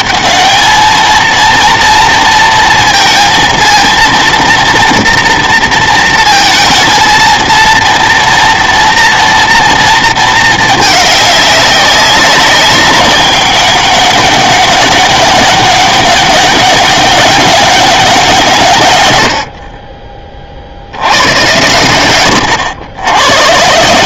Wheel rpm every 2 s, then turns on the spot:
220, 230, 230, 220, 230, 220, 190, 200, 200, 120, 70, 90.
none